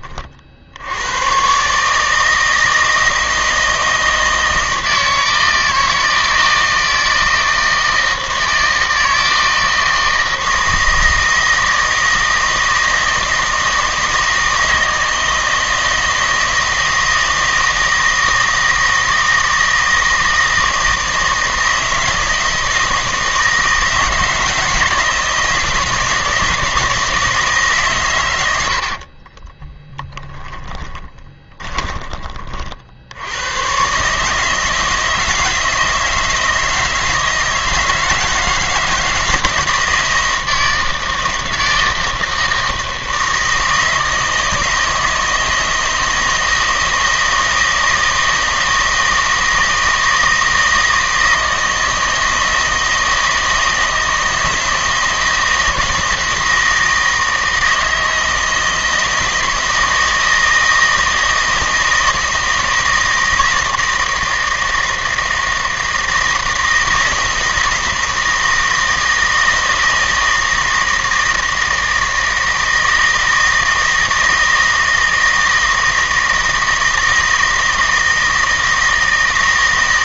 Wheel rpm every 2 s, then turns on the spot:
70, 160, 160, 160, 160, 160, 160, 160, 160, 160, 160, 160, 160, 160, 80, 20, 40, 160, 160, 160, 160, 160, 160, 160, 160, 160, 160, 160, 160, 160, 160, 160, 160, 160, 160, 160, 160, 160, 160, 160.
30-32